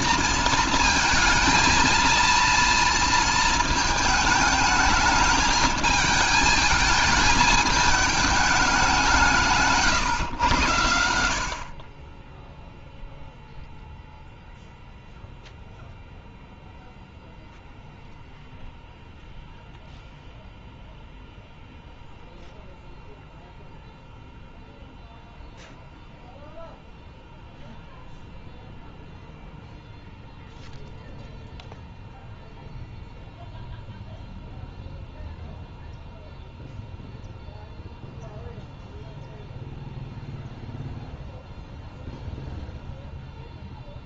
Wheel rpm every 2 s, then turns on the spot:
230, 230, 220, 220, 210, 110, 0, 0, 0, 0, 0, 0, 0, 0, 0, 0, 0, 0, 0, 0, 0, 0.
none